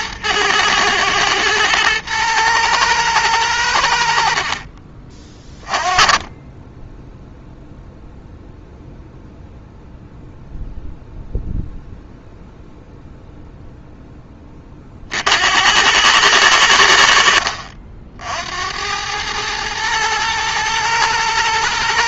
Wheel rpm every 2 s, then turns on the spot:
110, 110, 40, 10, 0, 0, 0, 40, 80, 90, 110.
none